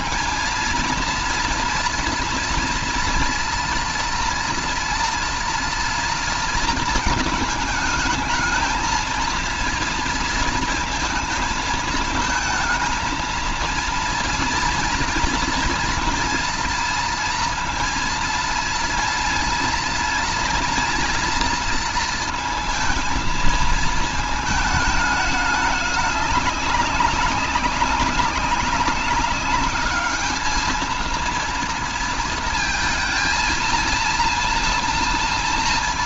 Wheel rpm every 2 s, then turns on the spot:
230, 230, 230, 220, 220, 220, 230, 230, 230, 230, 230, 220, 210, 200, 200, 220, 230, 230.
none